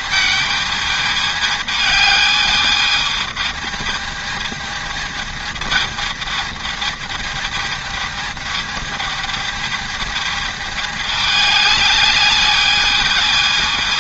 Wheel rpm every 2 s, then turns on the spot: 220, 210, 220, 220, 220, 210, 210.
none